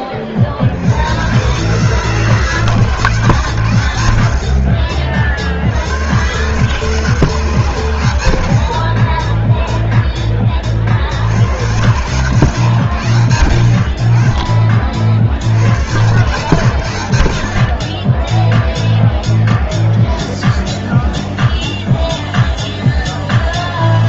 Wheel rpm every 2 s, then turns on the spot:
60, 150, 50, 130, 70, 30, 120, 30, 110, 0, 0, 0.
none